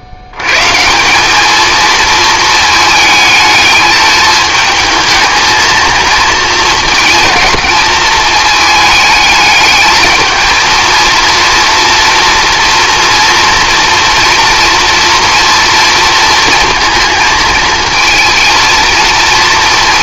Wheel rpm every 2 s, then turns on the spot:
160, 220, 220, 230, 220, 220, 230, 230, 230, 230.
none